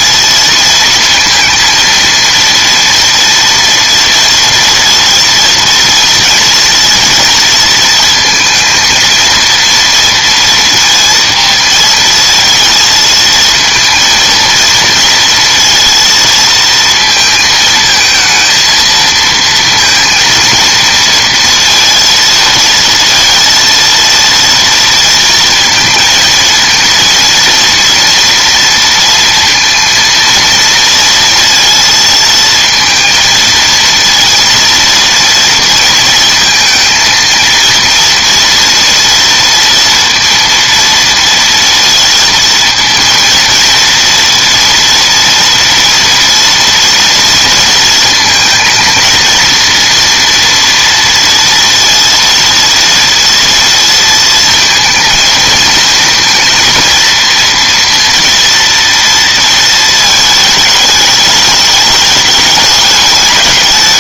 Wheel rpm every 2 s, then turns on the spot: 230, 230, 230, 230, 230, 230, 220, 230, 230, 230, 230, 230, 230, 230, 240, 230, 230, 230, 230, 240, 230, 230, 230, 230, 230, 230, 230, 230, 230, 230, 210, 210.
none